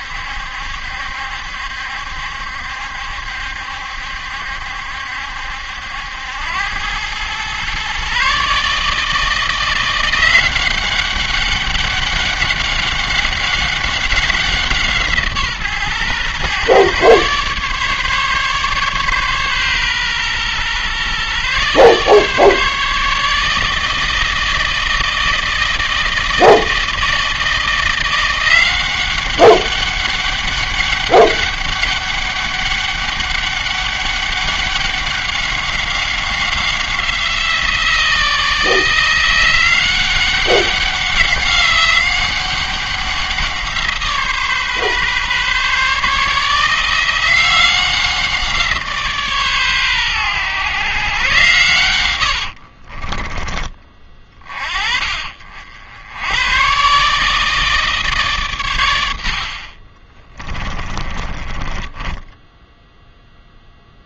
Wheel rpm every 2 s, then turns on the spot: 70, 70, 70, 100, 150, 190, 200, 170, 130, 140, 130, 150, 160, 160, 180, 200, 200, 200, 180, 160, 190, 190, 140, 170, 160, 120, 60, 30, 130, 110, 20, 10.
52-54 60-64